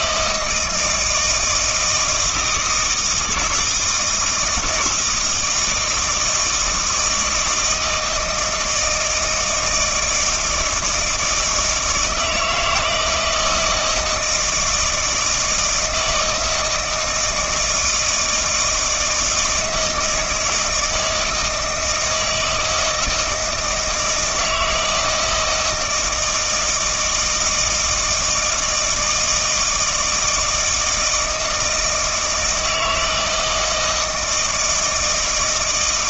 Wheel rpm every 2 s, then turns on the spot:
160, 160, 160, 160, 160, 160, 160, 160, 160, 160, 160, 160, 160, 160, 160, 160, 160, 170.
none